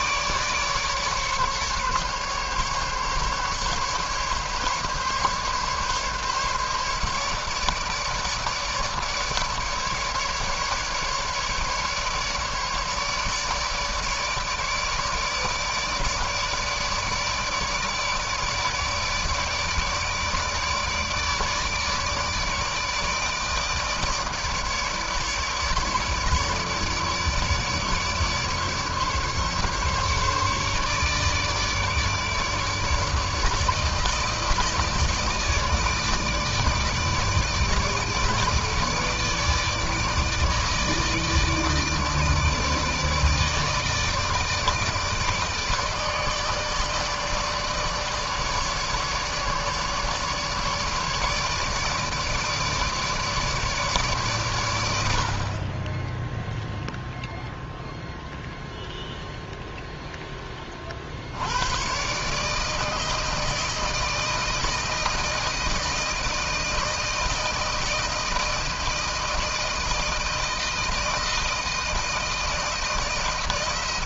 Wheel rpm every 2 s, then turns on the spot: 150, 140, 140, 150, 150, 150, 150, 150, 150, 150, 150, 150, 150, 150, 150, 150, 150, 160, 160, 150, 150, 160, 160, 160, 150, 150, 150, 120, 0, 0, 30, 150, 160, 160, 160, 160, 160.
none